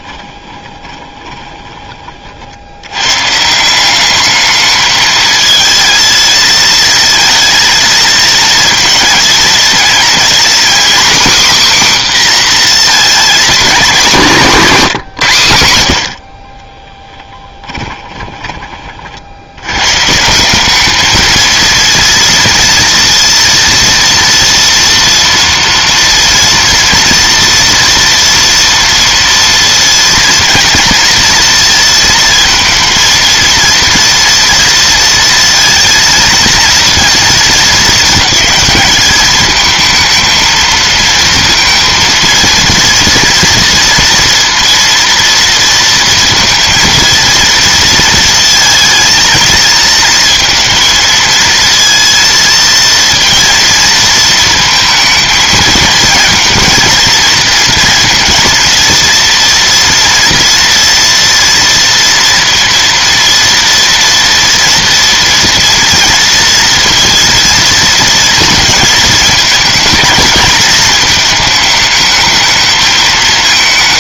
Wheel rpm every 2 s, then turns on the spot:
20, 90, 220, 230, 230, 250, 240, 190, 20, 30, 200, 230, 230, 230, 230, 230, 230, 230, 230, 210, 220, 230, 230, 230, 220, 230, 230, 230, 230, 230, 230, 230, 230, 230, 220, 220, 220.
0-2 16-18